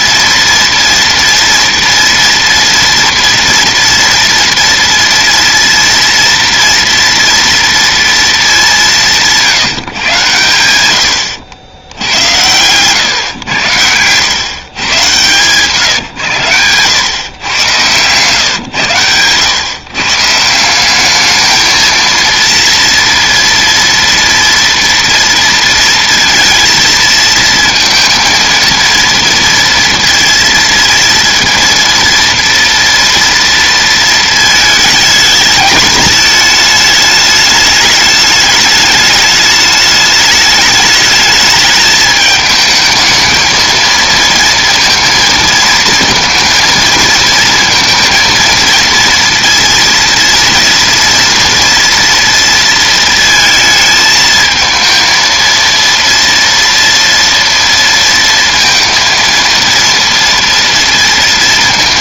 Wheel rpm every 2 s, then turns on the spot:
230, 230, 230, 230, 200, 110, 120, 120, 110, 120, 190, 230, 230, 230, 230, 230, 230, 220, 220, 210, 210, 220, 230, 230, 230, 230, 230, 220, 230, 230, 230.
none